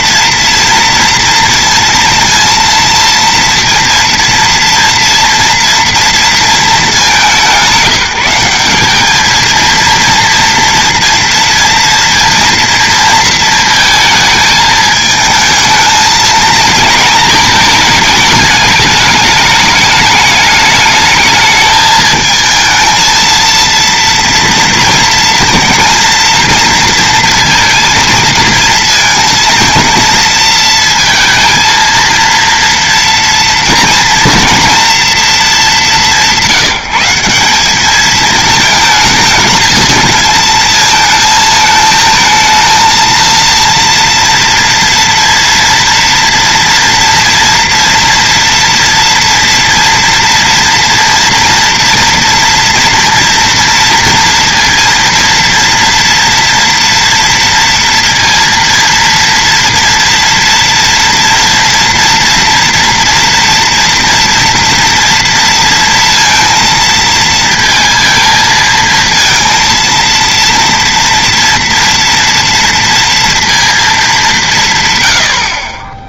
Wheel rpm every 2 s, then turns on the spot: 230, 230, 230, 220, 190, 230, 230, 220, 230, 210, 210, 220, 230, 230, 230, 230, 230, 230, 180, 220, 220, 230, 230, 230, 230, 230, 230, 230, 230, 230, 230, 230, 230, 220, 220, 230, 230, 150.
none